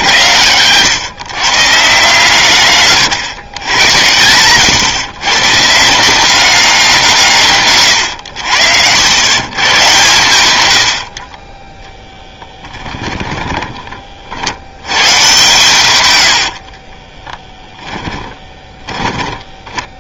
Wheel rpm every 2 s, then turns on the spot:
100, 130, 120, 190, 80, 120, 10, 90, 60, 20.
12-14 16-20